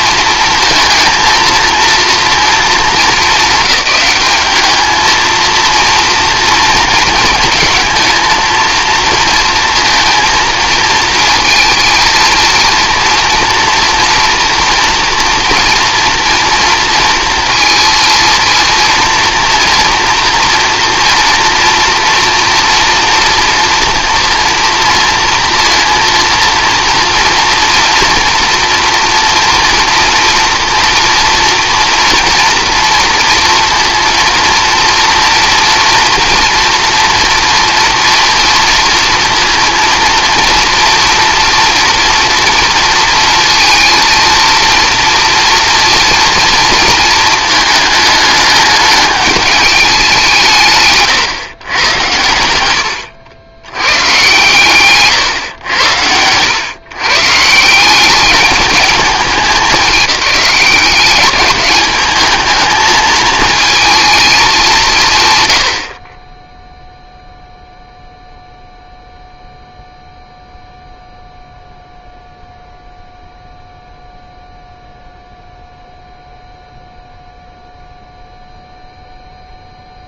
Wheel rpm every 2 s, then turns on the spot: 230, 210, 210, 230, 220, 230, 230, 230, 230, 230, 230, 230, 230, 230, 230, 230, 230, 240, 230, 230, 230, 230, 230, 230, 210, 160, 100, 130, 120, 210, 190, 220, 190, 0, 0, 0, 0, 0, 0, 0.
52-54